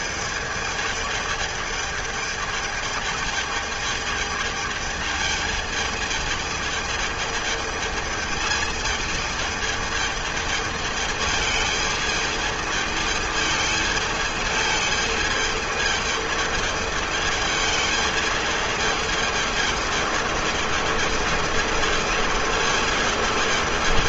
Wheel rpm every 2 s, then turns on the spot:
220, 220, 220, 220, 220, 220, 220, 220, 220, 220, 220, 220.
none